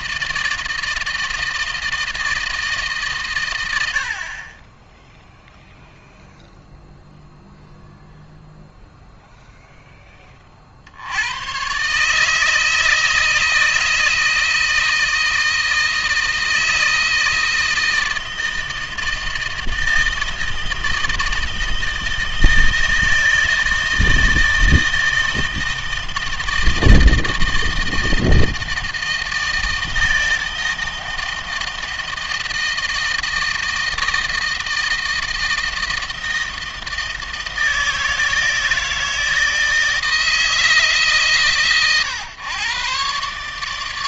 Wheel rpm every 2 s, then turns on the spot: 160, 150, 10, 0, 0, 60, 160, 160, 160, 160, 160, 160, 160, 160, 160, 160, 160, 160, 160, 160, 150, 130.
none